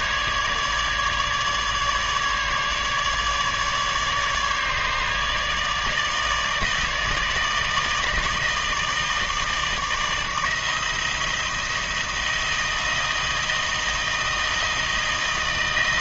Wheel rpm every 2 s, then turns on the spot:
150, 150, 150, 160, 160, 160, 170, 160.
none